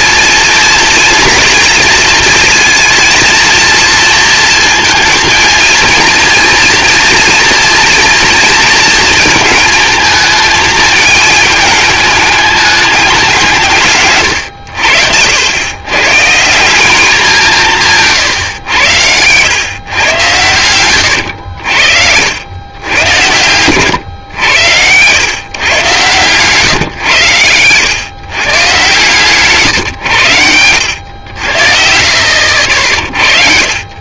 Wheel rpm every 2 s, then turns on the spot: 230, 230, 230, 230, 230, 220, 210, 100, 180, 110, 100, 80, 100, 120, 120, 100, 70.
none